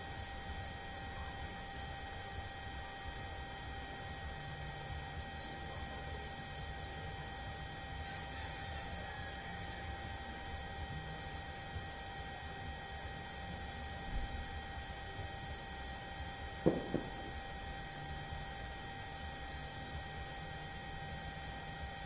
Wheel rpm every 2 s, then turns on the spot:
0, 0, 0, 0, 0, 0, 0, 0, 0, 0, 0.
none